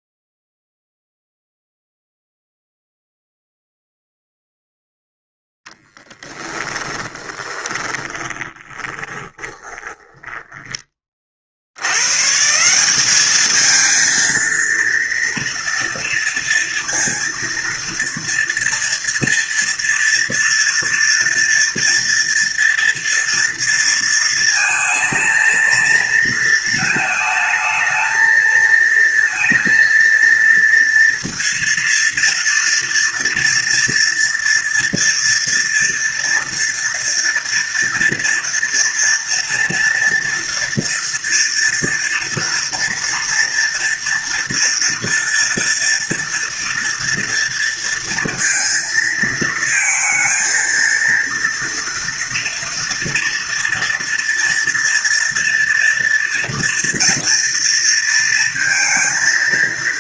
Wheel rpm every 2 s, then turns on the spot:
0, 0, 0, 30, 20, 20, 170, 230, 230, 230, 230, 230, 230, 230, 230, 230, 230, 240, 230, 230, 230, 230, 240, 240, 230, 220, 230, 230, 240, 230.
6-12